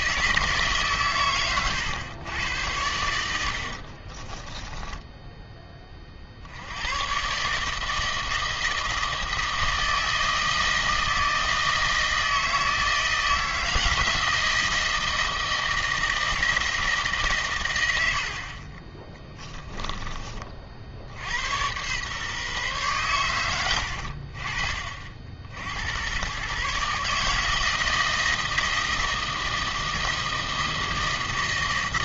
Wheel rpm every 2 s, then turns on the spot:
150, 100, 10, 80, 160, 160, 160, 160, 160, 40, 50, 130, 50, 130, 160, 160.
4-6